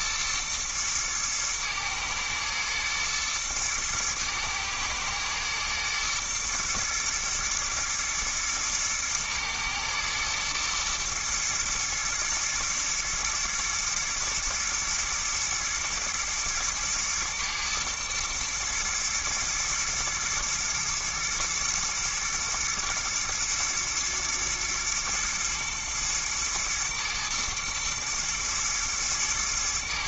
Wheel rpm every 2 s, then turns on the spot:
110, 110, 110, 110, 110, 110, 110, 120, 110, 110, 110, 110, 120, 120, 120.
none